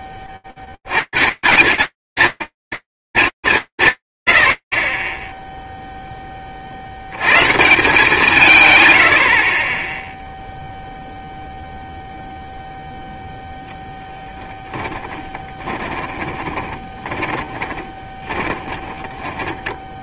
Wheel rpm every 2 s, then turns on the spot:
110, 230, 50, 40, 110, 0, 0, 20, 30, 20.
14-20